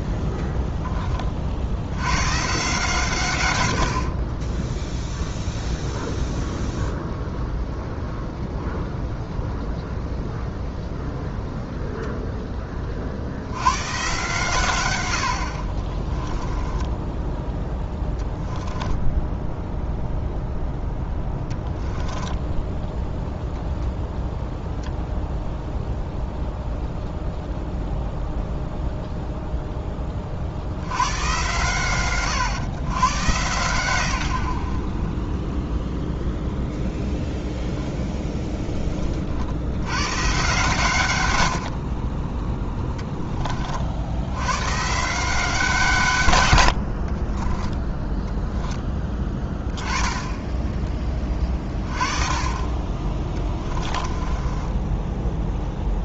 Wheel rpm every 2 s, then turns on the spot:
10, 140, 10, 10, 10, 10, 40, 110, 10, 10, 10, 10, 0, 0, 0, 70, 120, 80, 10, 10, 130, 10, 90, 120, 10, 10, 30, 20.
16-18 22-24 48-50 54-56